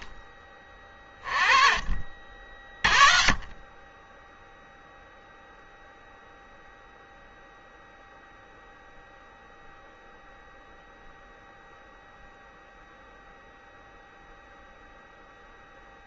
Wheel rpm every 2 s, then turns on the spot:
30, 40, 10, 0, 0, 0, 0, 0.
none